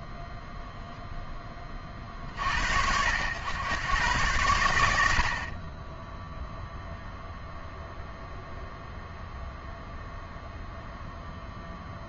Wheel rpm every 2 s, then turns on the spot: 0, 80, 70, 0, 0, 0.
none